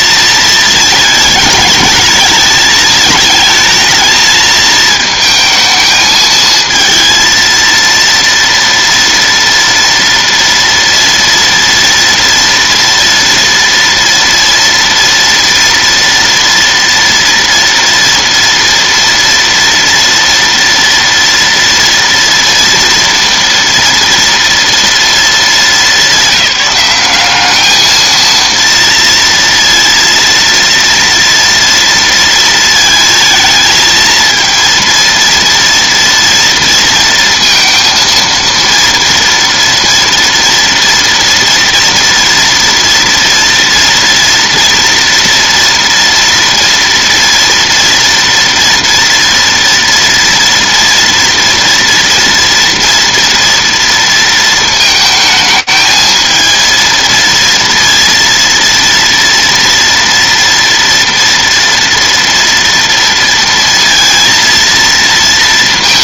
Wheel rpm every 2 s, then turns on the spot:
220, 220, 220, 220, 230, 230, 230, 230, 240, 240, 230, 230, 230, 190, 230, 230, 230, 230, 230, 230, 230, 230, 230, 230, 230, 230, 230, 220, 220, 230, 240, 230, 230.
none